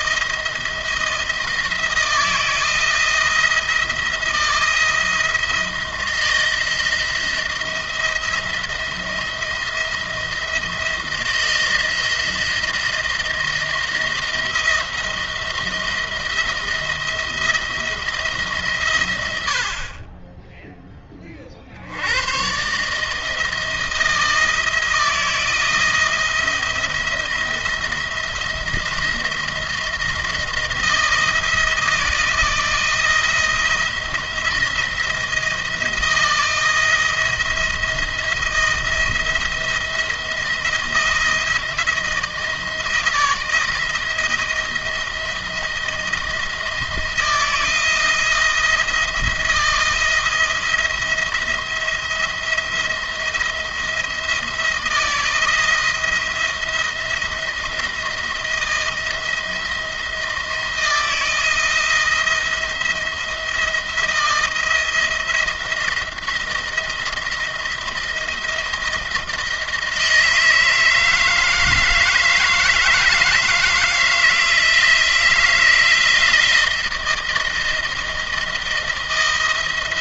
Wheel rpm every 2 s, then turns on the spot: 170, 170, 160, 170, 170, 170, 170, 170, 170, 130, 10, 140, 170, 170, 170, 170, 170, 170, 170, 170, 170, 160, 160, 170, 170, 170, 170, 160, 170, 170, 170, 170, 170, 170, 170, 160, 160, 170, 170, 170.
none